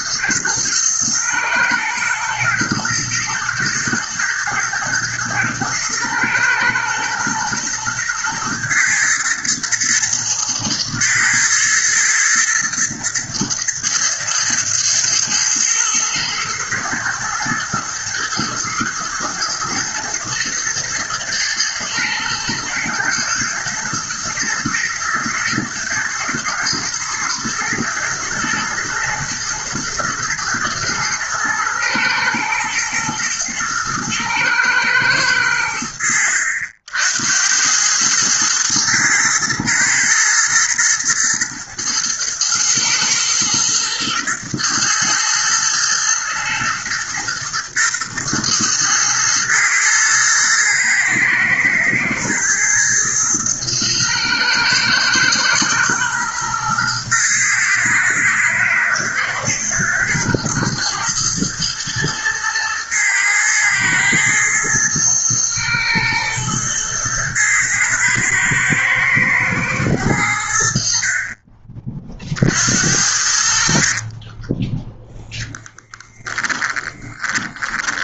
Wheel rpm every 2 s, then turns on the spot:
110, 120, 110, 110, 110, 120, 120, 110, 110, 120, 110, 110, 110, 110, 120, 110, 110, 110, 80, 110, 120, 110, 110, 120, 110, 110, 110, 110, 110, 110, 110, 110, 110, 110, 110, 60, 60, 20, 20.
76-78